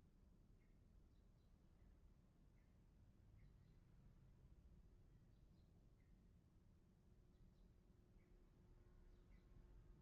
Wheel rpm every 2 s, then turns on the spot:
0, 0, 0, 0, 0.
none